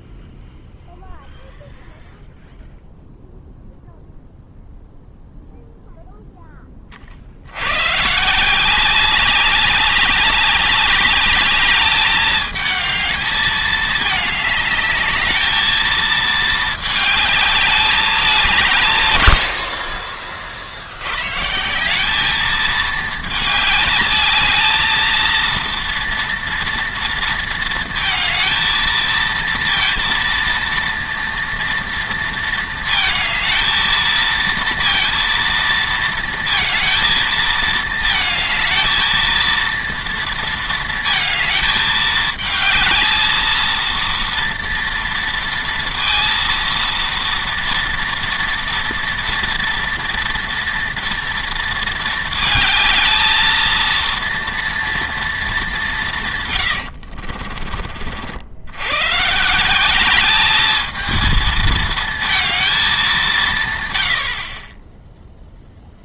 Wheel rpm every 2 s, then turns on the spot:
0, 0, 0, 10, 170, 200, 210, 210, 220, 170, 50, 220, 220, 230, 220, 230, 230, 230, 230, 220, 230, 220, 230, 230, 230, 230, 220, 230, 120, 90, 210, 220, 40.
56-58